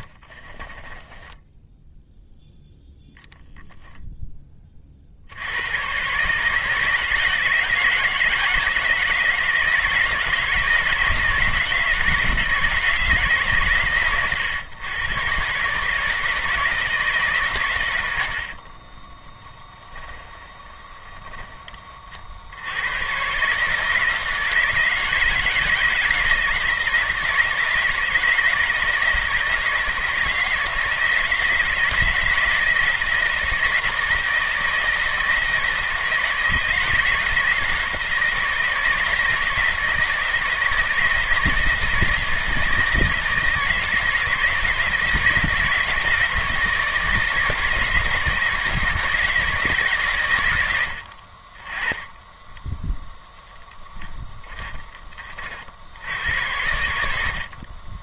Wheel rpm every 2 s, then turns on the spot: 10, 0, 50, 160, 160, 160, 160, 110, 150, 30, 20, 100, 160, 170, 160, 170, 160, 160, 160, 160, 160, 160, 160, 160, 160, 70, 10, 30, 90.
0-2 18-22 52-54